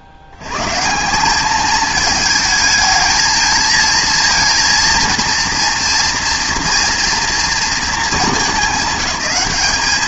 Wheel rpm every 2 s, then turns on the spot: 70, 220, 230, 230, 200.
none